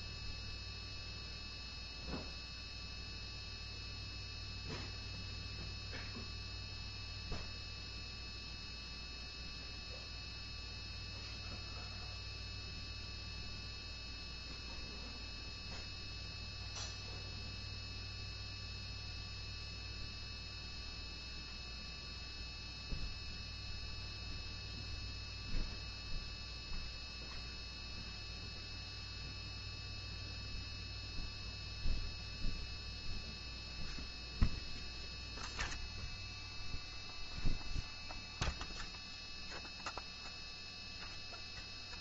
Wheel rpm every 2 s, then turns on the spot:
0, 0, 0, 0, 0, 0, 0, 0, 0, 0, 0, 0, 0, 0, 0, 0, 0, 0, 0, 0, 0.
none